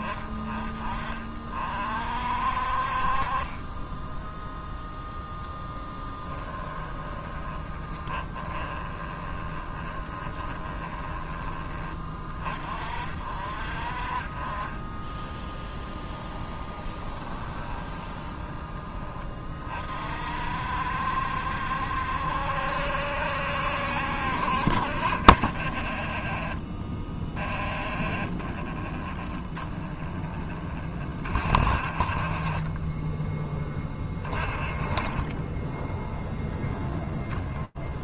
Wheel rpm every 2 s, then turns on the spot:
20, 50, 0, 10, 20, 20, 40, 20, 20, 20, 60, 70, 60, 30, 30, 30, 30, 20, 0.
6-12 16-18 28-30